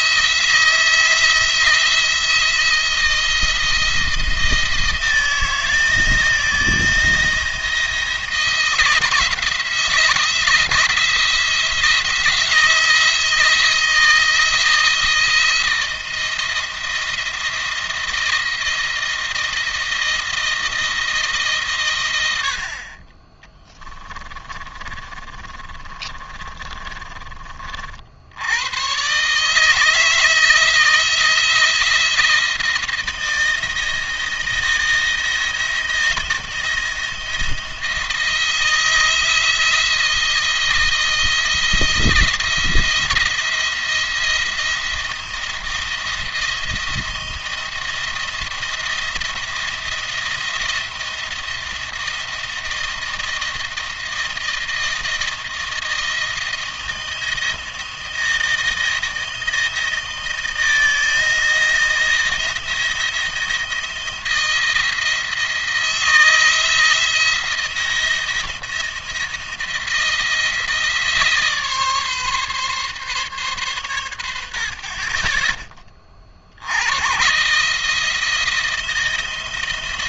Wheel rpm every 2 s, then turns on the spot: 170, 170, 170, 170, 170, 170, 160, 160, 160, 170, 160, 60, 30, 30, 100, 160, 170, 170, 170, 160, 160, 170, 170, 170, 170, 170, 170, 170, 160, 160, 160, 170, 160, 160, 170, 160, 140, 60, 80, 170.
24-28